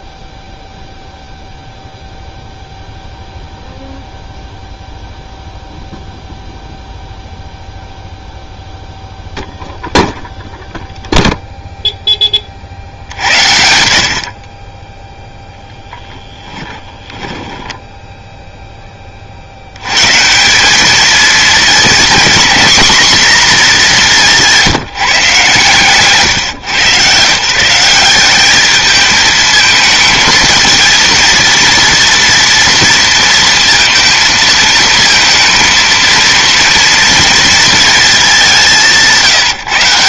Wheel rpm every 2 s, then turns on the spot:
0, 0, 0, 0, 0, 0, 50, 30, 10, 10, 200, 230, 180, 130, 210, 230, 230, 220, 230, 190.
16-18